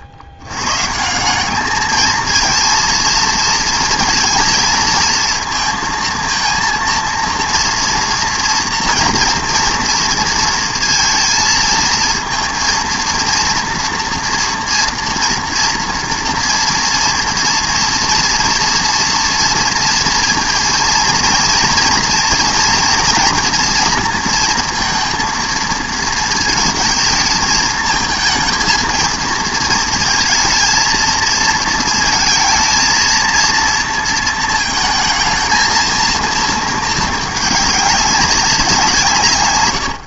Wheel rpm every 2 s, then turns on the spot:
110, 230, 230, 230, 230, 230, 230, 230, 230, 230, 230, 230, 230, 220, 230, 230, 230, 230, 230, 190.
none